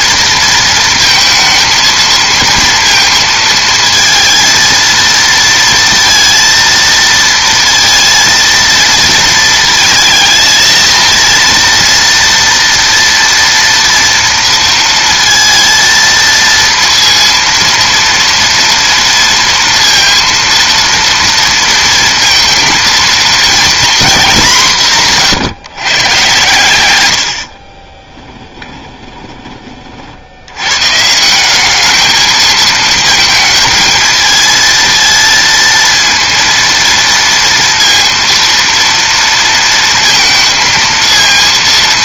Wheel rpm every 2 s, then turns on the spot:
230, 230, 230, 230, 230, 220, 230, 230, 230, 230, 230, 230, 180, 100, 20, 110, 220, 230, 230, 230, 220.
26-30